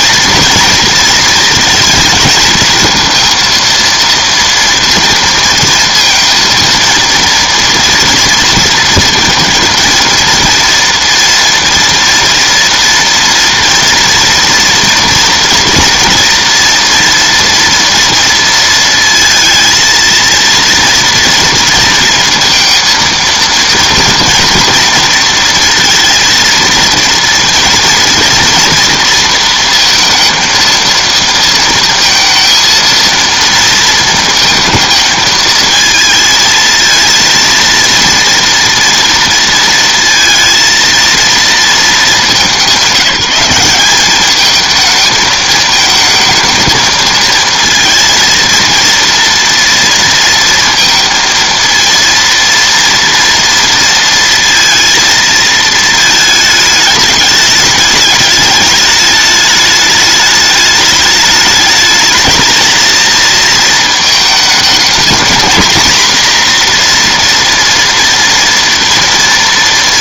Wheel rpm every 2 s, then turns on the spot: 230, 220, 230, 230, 230, 230, 240, 230, 230, 230, 230, 230, 230, 230, 240, 230, 230, 230, 220, 230, 230, 200, 220, 220, 230, 230, 230, 230, 210, 210, 210, 220, 220, 240, 230.
none